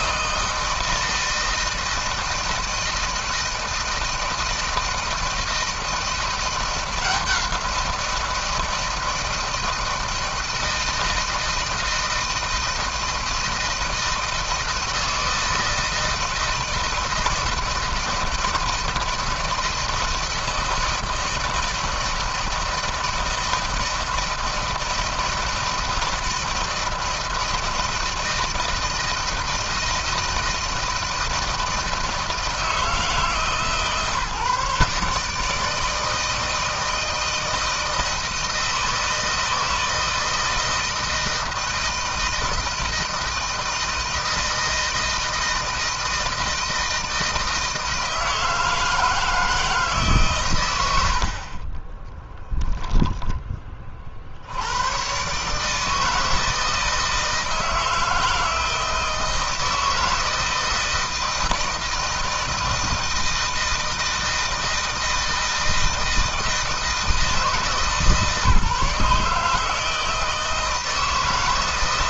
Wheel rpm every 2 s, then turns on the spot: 160, 160, 160, 170, 160, 160, 160, 160, 160, 160, 160, 160, 160, 160, 160, 160, 160, 140, 160, 160, 160, 160, 160, 160, 160, 110, 0, 90, 160, 160, 160, 160, 160, 160, 150, 160.
none